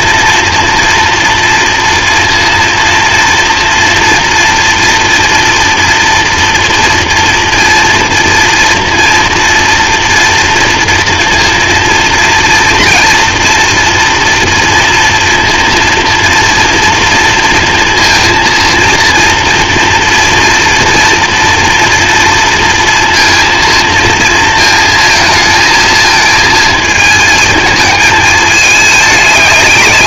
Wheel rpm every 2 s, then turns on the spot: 230, 230, 240, 240, 230, 230, 230, 230, 230, 230, 230, 230, 230, 230, 210.
none